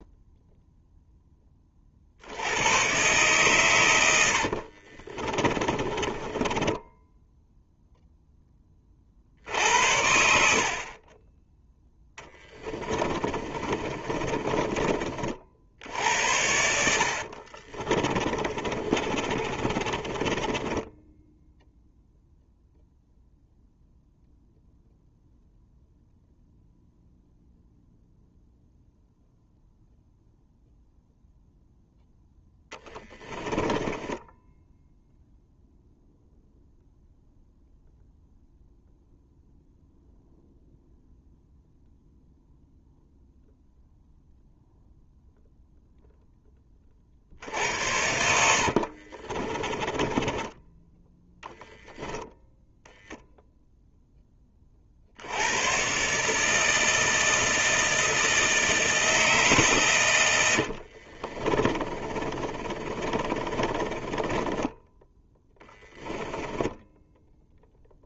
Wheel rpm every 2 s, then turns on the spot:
0, 120, 50, 10, 30, 40, 20, 30, 70, 30, 10, 0, 0, 0, 0, 0, 10, 0, 0, 0, 0, 0, 0, 30, 60, 10, 0, 60, 160, 160, 60, 30, 10, 10.
4-6 12-14 16-22 32-34 48-50 60-68